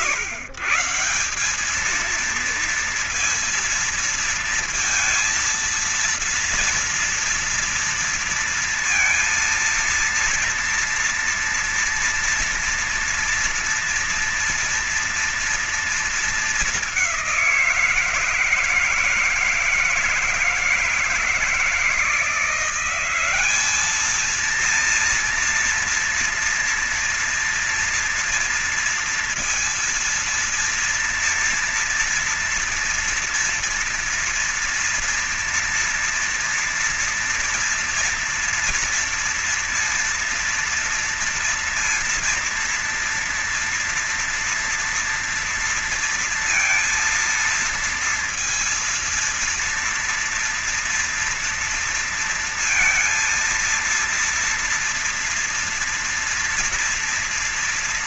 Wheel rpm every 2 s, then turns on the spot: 140, 220, 230, 230, 230, 230, 230, 230, 220, 160, 160, 170, 220, 230, 240, 230, 230, 230, 230, 230, 240, 230, 230, 230, 230, 230, 230, 230, 230.
none